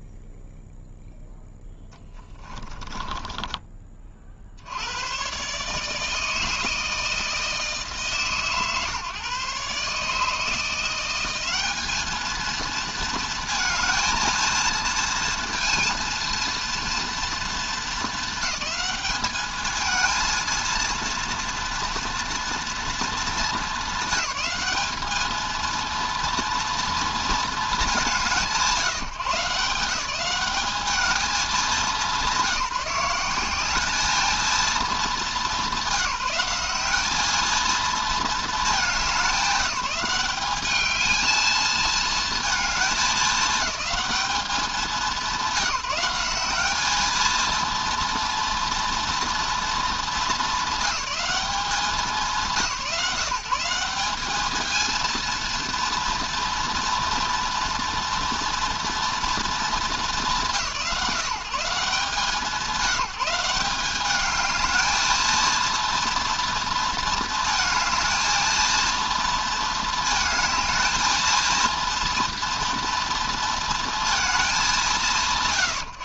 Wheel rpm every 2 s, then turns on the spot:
0, 20, 90, 160, 130, 170, 230, 230, 230, 210, 220, 220, 200, 240, 150, 190, 190, 200, 190, 200, 210, 220, 190, 210, 230, 190, 150, 220, 230, 230, 160, 170, 220, 230, 230, 220, 230, 170.
2-4